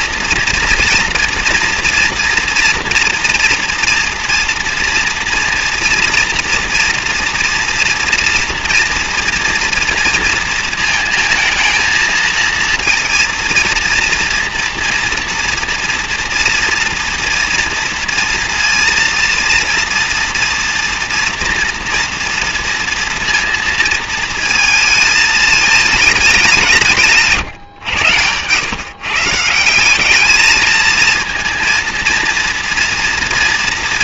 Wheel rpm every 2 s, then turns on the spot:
230, 240, 230, 230, 230, 230, 230, 230, 230, 230, 240, 230, 220, 180, 120, 220, 230.
none